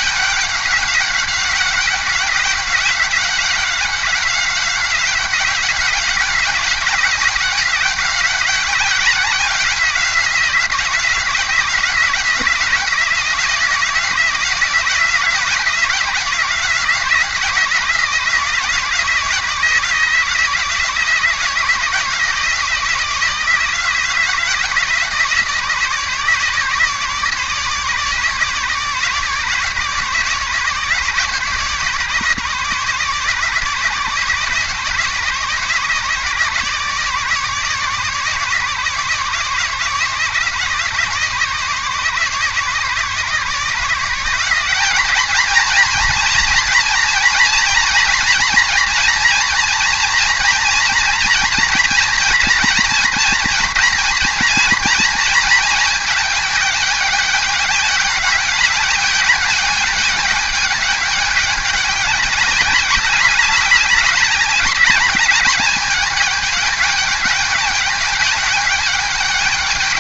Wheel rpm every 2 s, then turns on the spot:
200, 190, 180, 190, 180, 180, 170, 170, 170, 160, 160, 160, 160, 150, 150, 150, 150, 150, 150, 150, 150, 150, 180, 230, 230, 230, 230, 240, 210, 200, 200, 200, 200, 220, 200.
none